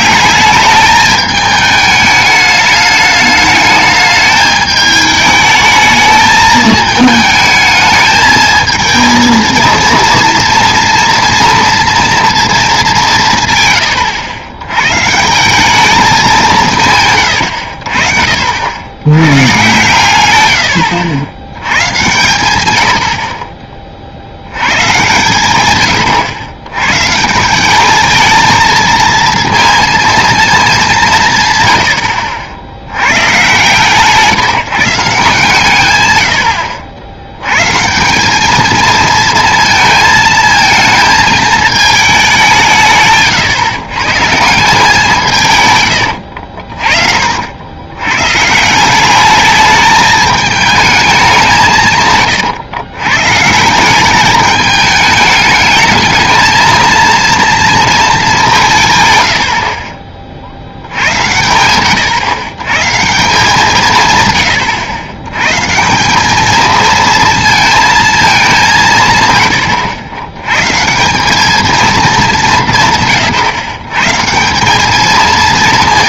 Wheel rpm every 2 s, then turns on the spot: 210, 210, 210, 220, 220, 230, 210, 110, 140, 70, 90, 100, 120, 110, 230, 210, 90, 160, 70, 220, 220, 170, 170, 60, 170, 220, 120, 210, 220, 160, 70, 140, 90, 220, 180, 130, 160, 200.
46-48